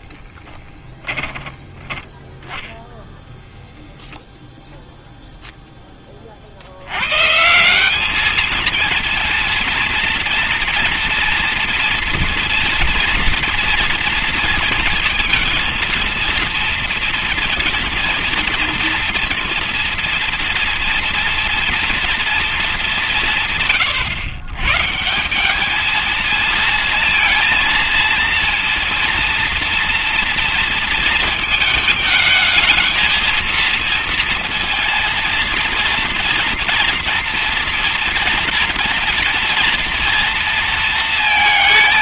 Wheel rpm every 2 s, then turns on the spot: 10, 10, 0, 70, 220, 230, 230, 230, 230, 230, 230, 220, 130, 220, 230, 230, 220, 230, 230, 230, 230.
none